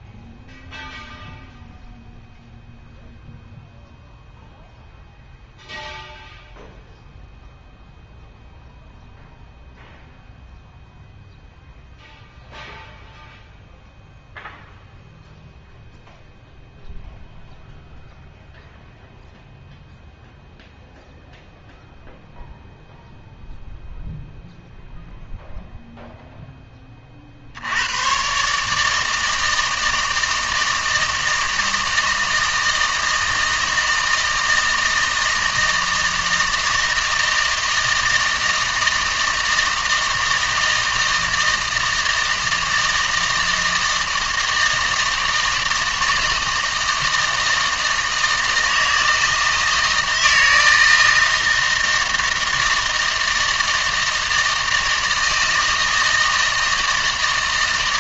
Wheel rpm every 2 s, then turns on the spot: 0, 0, 0, 0, 0, 0, 0, 0, 0, 0, 0, 0, 0, 10, 150, 160, 160, 160, 160, 160, 160, 160, 160, 160, 160, 160, 160, 160, 160.
none